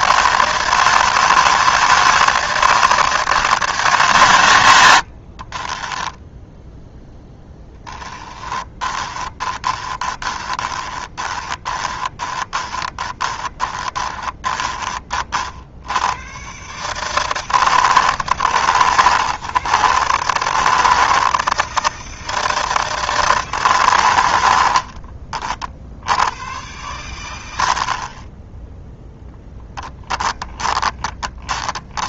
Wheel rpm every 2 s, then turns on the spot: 160, 160, 70, 10, 20, 20, 20, 30, 150, 100, 160, 160, 40, 100, 10, 20.
4-6 8-14 24-26 30-32